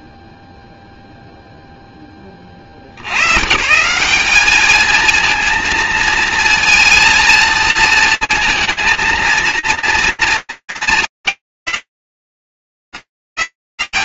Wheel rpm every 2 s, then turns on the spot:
0, 50, 220, 230, 230, 230, 130.
none